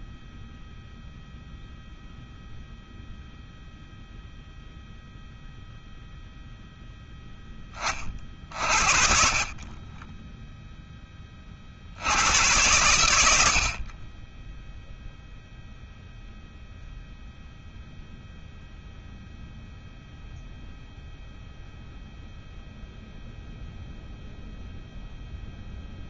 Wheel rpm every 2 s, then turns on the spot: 0, 0, 0, 0, 30, 20, 80, 0, 0, 0, 0, 0, 0.
none